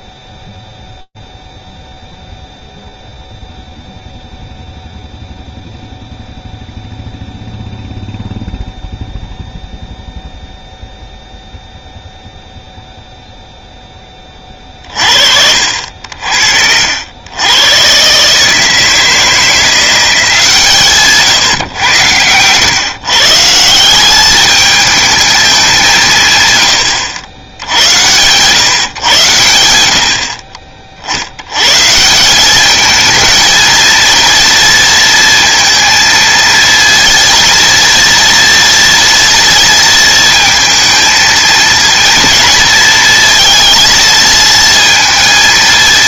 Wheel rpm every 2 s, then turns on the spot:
0, 0, 0, 0, 0, 0, 0, 30, 70, 150, 160, 120, 210, 120, 120, 40, 200, 230, 230, 230, 230, 230, 230.
none